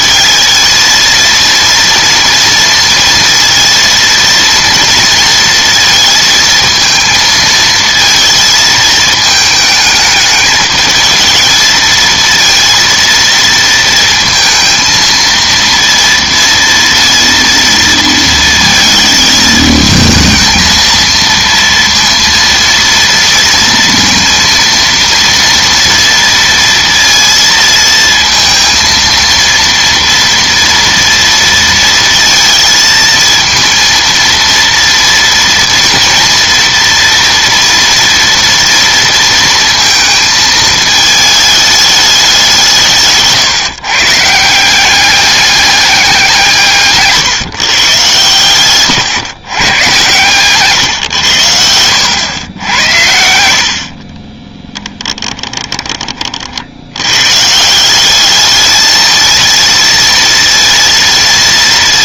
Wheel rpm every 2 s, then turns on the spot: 230, 230, 230, 230, 220, 220, 230, 230, 230, 220, 230, 230, 230, 230, 230, 230, 220, 230, 230, 230, 220, 160, 190, 160, 110, 130, 90, 10, 90, 220, 230.
50-52 54-56